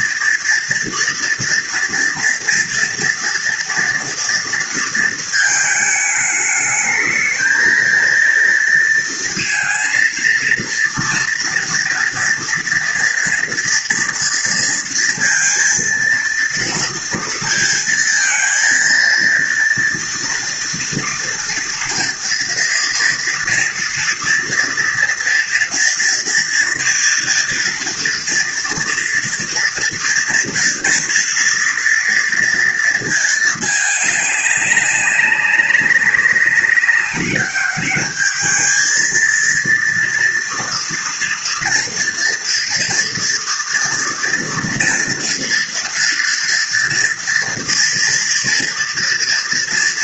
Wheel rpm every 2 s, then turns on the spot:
230, 230, 230, 210, 230, 230, 230, 230, 230, 230, 230, 230, 230, 240, 230, 230, 230, 200, 190, 220, 230, 230, 240, 230, 230.
none